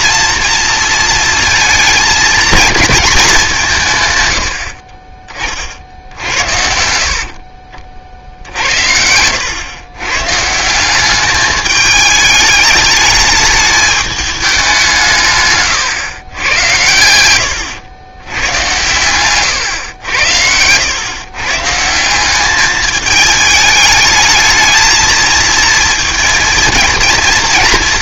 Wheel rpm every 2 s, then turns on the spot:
230, 230, 70, 70, 60, 160, 210, 200, 100, 110, 90, 210, 220, 220.
none